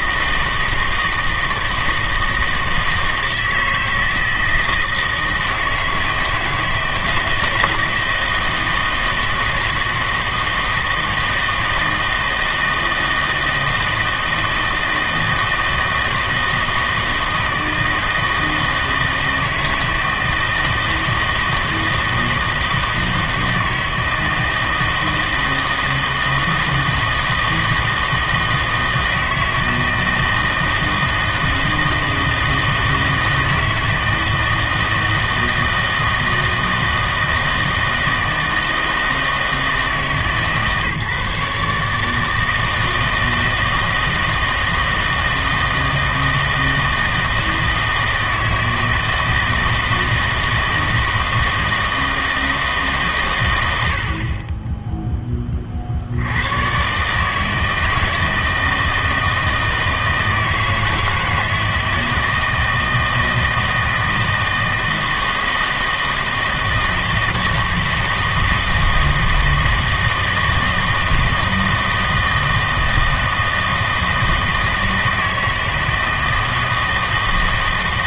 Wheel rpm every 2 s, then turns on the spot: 160, 160, 160, 160, 160, 160, 160, 160, 160, 160, 160, 160, 160, 160, 160, 160, 160, 160, 160, 160, 150, 160, 160, 160, 160, 160, 160, 20, 110, 160, 160, 160, 160, 160, 160, 160, 160, 160, 160.
none